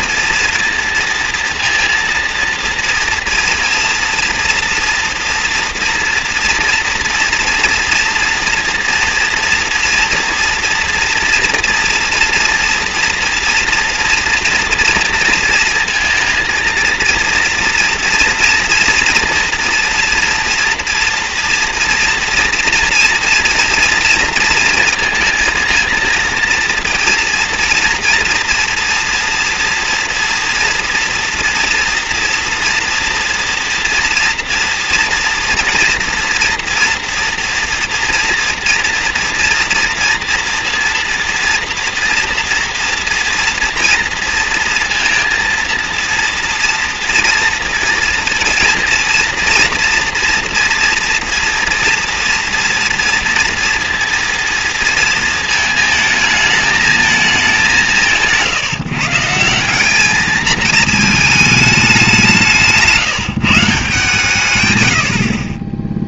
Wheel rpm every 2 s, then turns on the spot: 230, 230, 240, 240, 230, 230, 230, 230, 230, 230, 230, 230, 230, 230, 230, 230, 230, 230, 240, 230, 230, 240, 230, 230, 230, 230, 230, 230, 220, 160, 220, 170, 110.
62-64